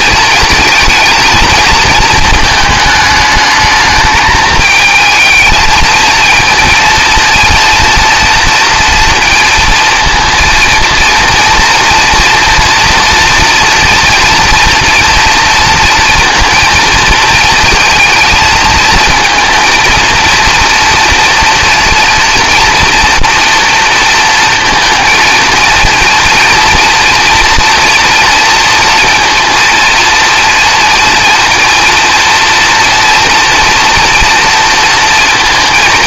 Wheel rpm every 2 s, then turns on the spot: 230, 220, 220, 230, 230, 230, 230, 230, 230, 220, 230, 230, 230, 230, 230, 230, 230, 230.
none